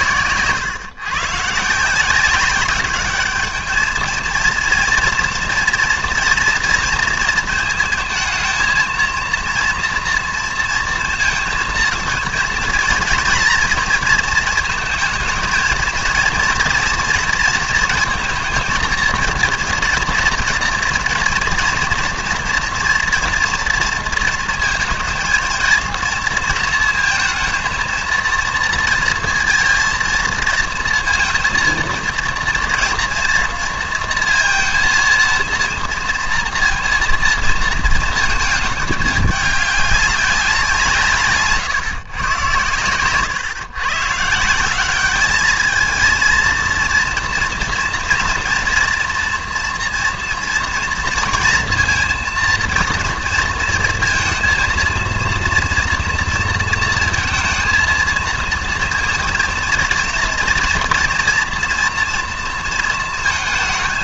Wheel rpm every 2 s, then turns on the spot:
130, 190, 230, 230, 220, 230, 220, 220, 240, 230, 240, 240, 230, 230, 230, 230, 230, 230, 230, 220, 170, 120, 180, 230, 230, 230, 230, 230, 230, 230, 240, 230.
none